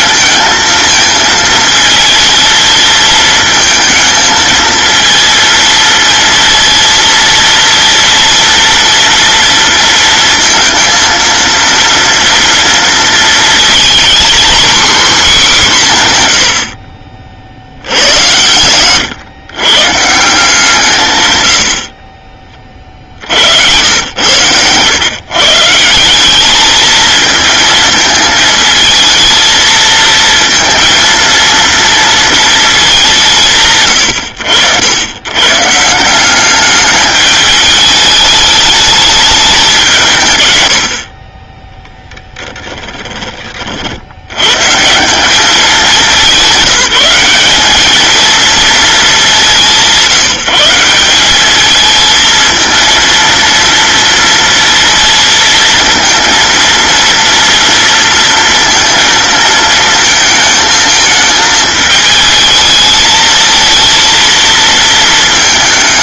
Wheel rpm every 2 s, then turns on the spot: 220, 220, 230, 230, 230, 230, 230, 250, 100, 100, 160, 20, 100, 210, 220, 230, 220, 90, 190, 210, 110, 10, 120, 180, 230, 160, 220, 230, 230, 230, 220, 220, 230.
42-44